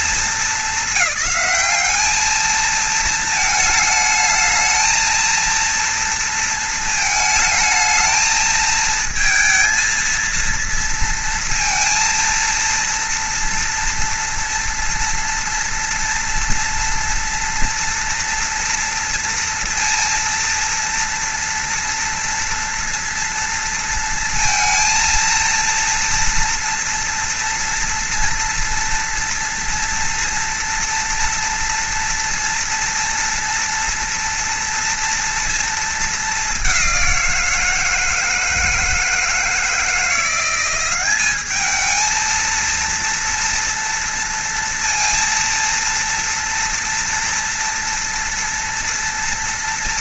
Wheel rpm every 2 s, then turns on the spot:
220, 220, 220, 230, 220, 230, 230, 230, 230, 230, 230, 230, 230, 230, 230, 230, 230, 230, 200, 160, 180, 230, 230, 240, 230.
none